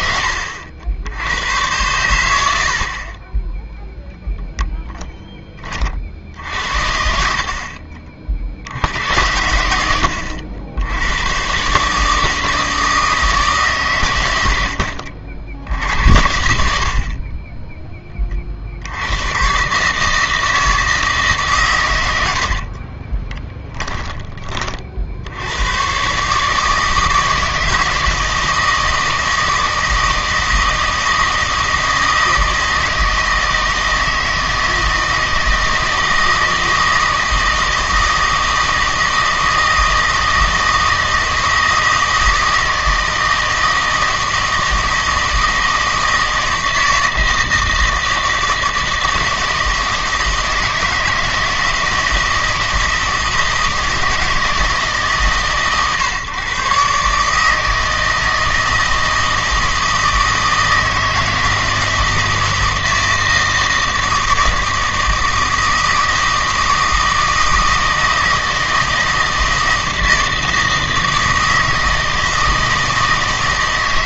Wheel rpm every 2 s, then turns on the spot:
70, 60, 10, 60, 80, 90, 160, 70, 50, 70, 160, 40, 40, 160, 160, 160, 160, 160, 160, 160, 160, 160, 160, 160, 160, 160, 160, 150, 130, 160, 160, 160, 160, 160, 160, 160, 160.
22-24